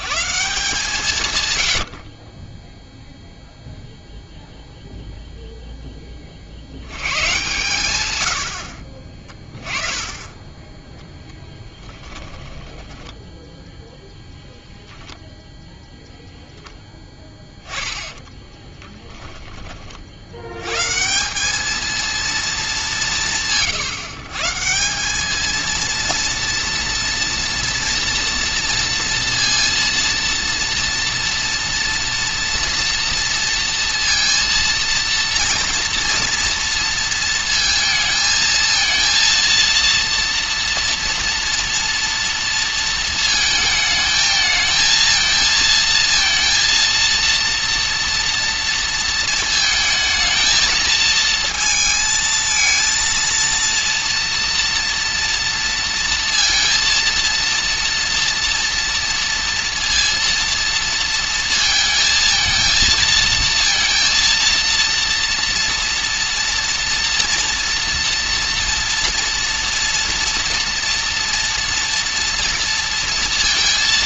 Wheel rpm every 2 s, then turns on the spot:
170, 10, 0, 60, 60, 10, 20, 0, 0, 10, 110, 210, 160, 230, 230, 230, 230, 230, 230, 230, 230, 230, 220, 230, 230, 220, 230, 230, 230, 230, 230, 220, 230, 230, 230, 240, 230.
12-14 18-20